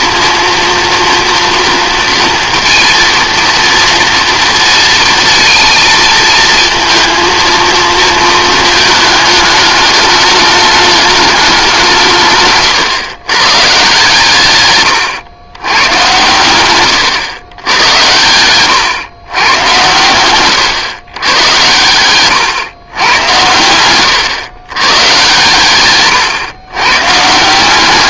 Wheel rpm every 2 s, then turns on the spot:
230, 230, 230, 230, 220, 210, 120, 130, 110, 110, 110, 120, 120, 120.
none